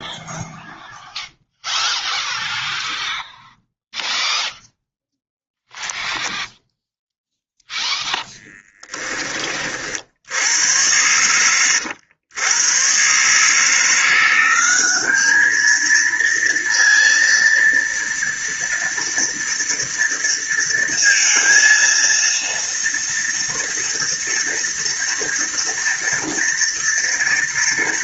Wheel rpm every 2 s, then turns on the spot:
0, 0, 0, 0, 10, 80, 100, 190, 230, 230, 230, 230, 230, 230.
8-10